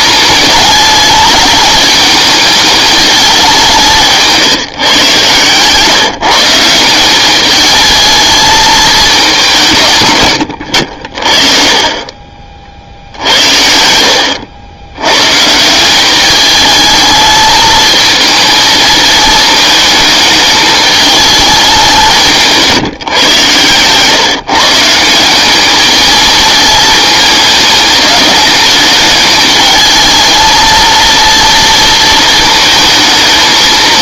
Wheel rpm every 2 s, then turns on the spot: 210, 210, 160, 170, 220, 80, 40, 90, 210, 220, 220, 160, 160, 220, 210, 230, 220.
none